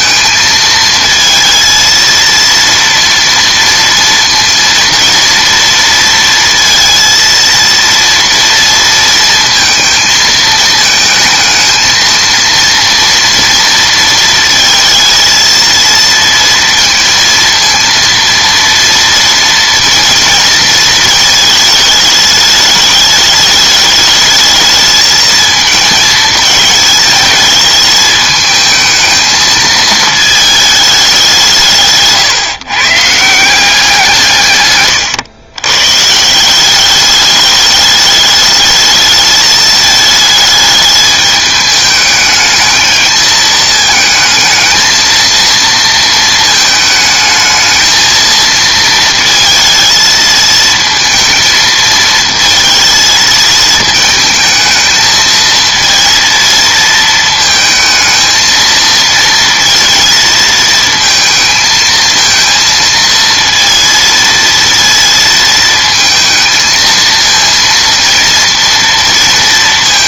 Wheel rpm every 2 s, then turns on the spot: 220, 230, 230, 230, 230, 220, 230, 230, 230, 230, 230, 210, 220, 220, 220, 220, 140, 130, 180, 210, 210, 220, 220, 220, 230, 230, 230, 220, 230, 230, 230, 230, 230, 220, 230.
none